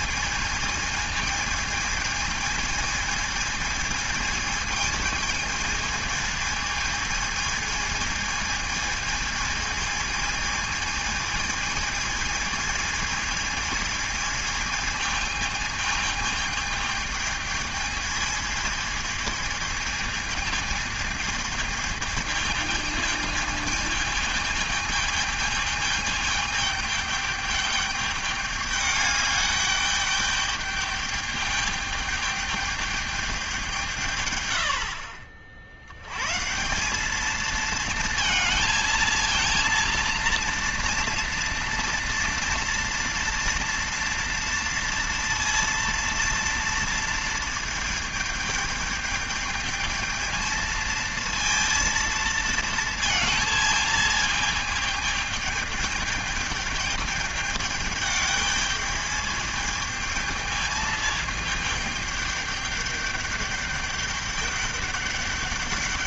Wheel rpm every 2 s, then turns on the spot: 220, 220, 220, 220, 220, 220, 220, 220, 220, 220, 220, 220, 220, 210, 210, 210, 210, 100, 170, 230, 230, 230, 230, 230, 210, 220, 230, 220, 210, 210, 220, 210, 200.
none